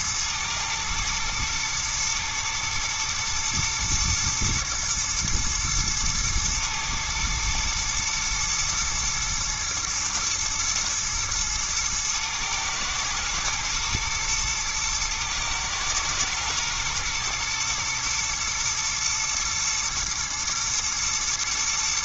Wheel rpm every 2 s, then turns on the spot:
120, 110, 110, 110, 110, 110, 110, 110, 110, 110, 120.
none